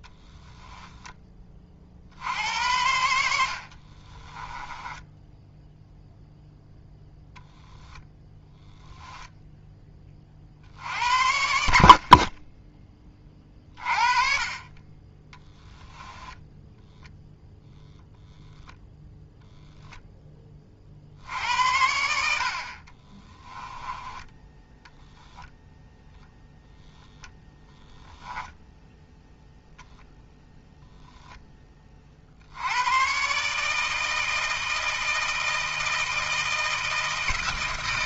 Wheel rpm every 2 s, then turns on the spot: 10, 80, 10, 0, 0, 60, 20, 30, 0, 0, 30, 50, 10, 0, 10, 0, 90, 160, 160.
0-2 4-6